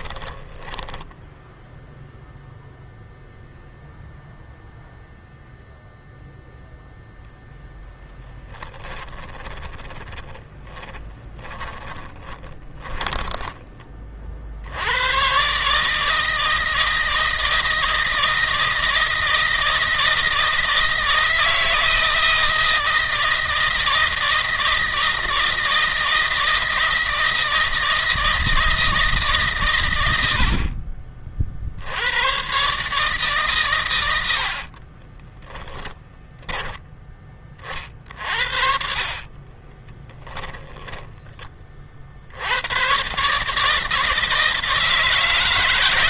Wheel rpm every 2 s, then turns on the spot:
10, 0, 0, 10, 20, 20, 10, 100, 160, 160, 160, 160, 160, 160, 150, 40, 140, 30, 10, 50, 10, 120, 160.
6-14 34-36 38-40